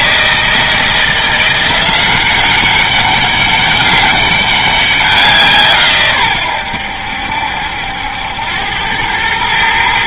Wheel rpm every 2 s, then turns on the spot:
170, 200, 190, 80, 100.
none